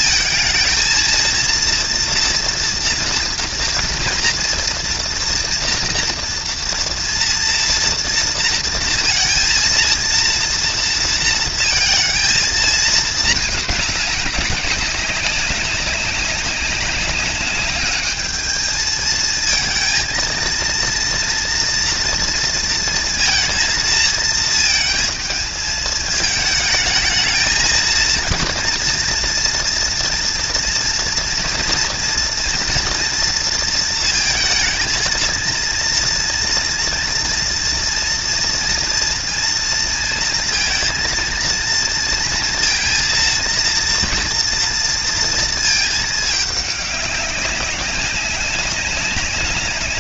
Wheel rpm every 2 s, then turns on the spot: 230, 230, 230, 230, 230, 230, 220, 190, 200, 220, 230, 230, 220, 220, 230, 240, 240, 220, 230, 230, 230, 230, 230, 210, 190.
none